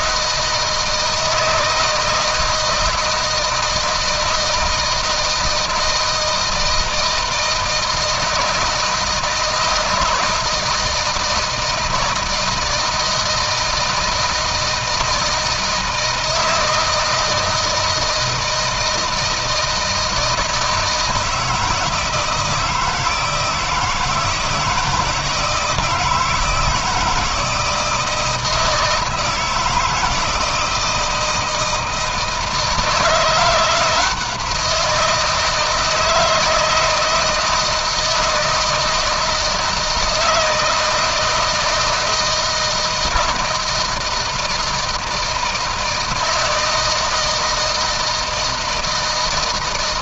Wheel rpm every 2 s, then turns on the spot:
160, 160, 160, 160, 170, 160, 170, 170, 160, 160, 160, 160, 160, 160, 160, 160, 160, 170, 160, 160, 160, 160, 160, 160, 160.
none